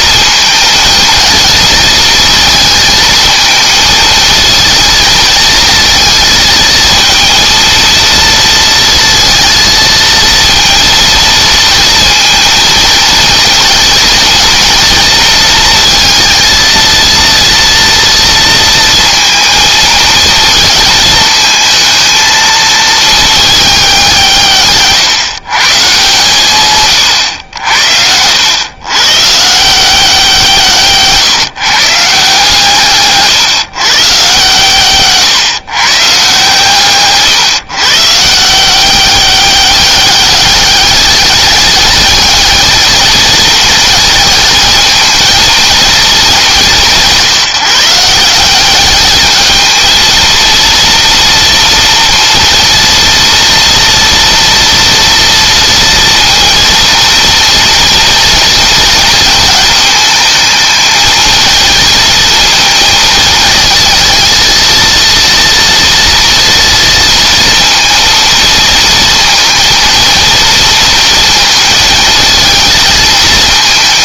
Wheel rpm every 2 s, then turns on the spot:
220, 220, 220, 230, 230, 230, 230, 230, 230, 230, 220, 220, 130, 120, 120, 150, 150, 150, 140, 180, 200, 220, 220, 170, 200, 230, 230, 230, 230, 230, 220, 230, 230, 230, 230, 230, 220.
none